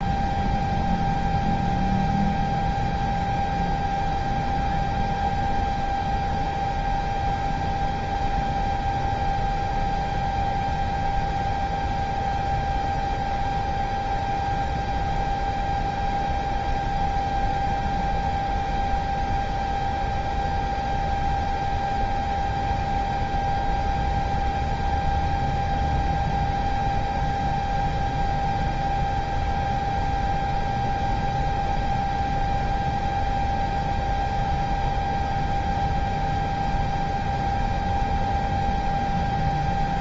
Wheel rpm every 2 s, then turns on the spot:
0, 0, 0, 0, 0, 0, 0, 0, 0, 0, 0, 0, 0, 0, 0, 0, 0, 0, 0, 0.
none